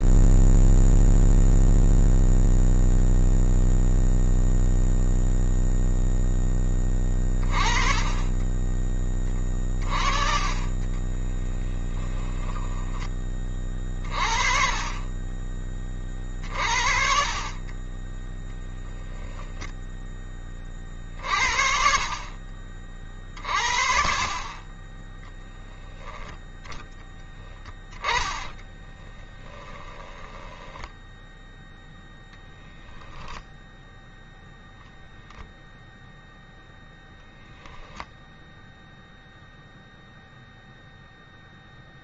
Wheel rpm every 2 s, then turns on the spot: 0, 0, 0, 20, 20, 10, 20, 20, 40, 0, 40, 40, 10, 10, 20, 10, 0, 0, 20, 0, 0.
10-12 26-30